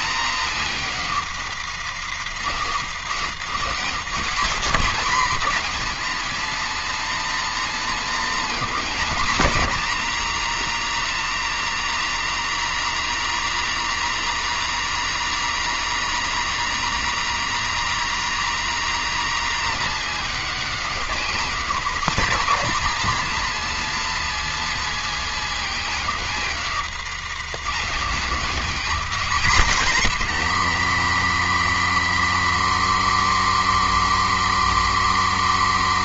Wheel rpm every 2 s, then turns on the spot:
250, 220, 260, 290, 290, 290, 290, 300, 300, 290, 270, 280, 280, 240, 260, 150, 140, 140.
none